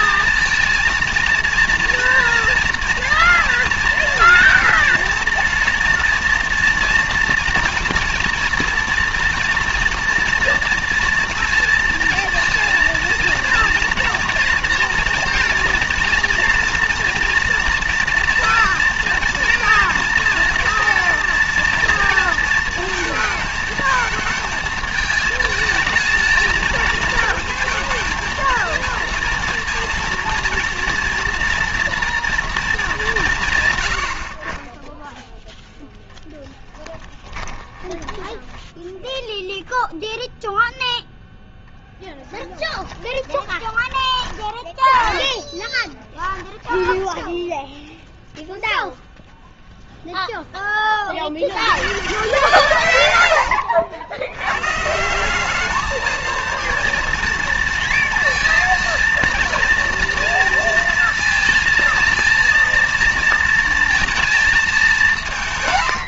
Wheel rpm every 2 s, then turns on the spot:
230, 230, 230, 230, 230, 230, 230, 230, 230, 230, 230, 230, 220, 220, 230, 230, 220, 20, 10, 10, 0, 20, 20, 10, 0, 30, 140, 150, 230, 230, 230, 230, 200.
36-40 42-48